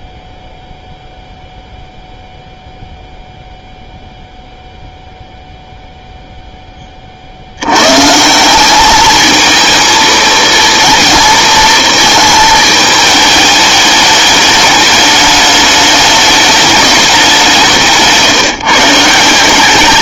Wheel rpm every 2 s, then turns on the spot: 0, 0, 0, 10, 190, 230, 220, 210, 210, 160.
none